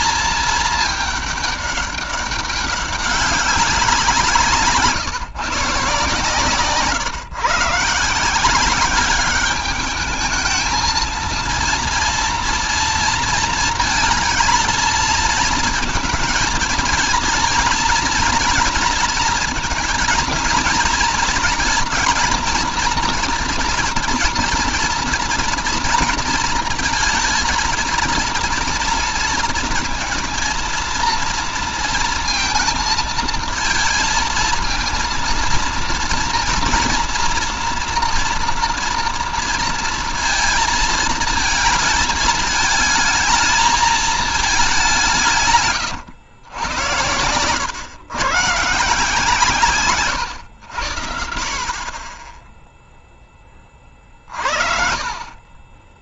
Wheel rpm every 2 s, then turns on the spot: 210, 200, 150, 140, 190, 230, 230, 230, 230, 230, 230, 230, 240, 220, 230, 230, 230, 230, 230, 230, 230, 220, 190, 100, 150, 90, 0, 50.
none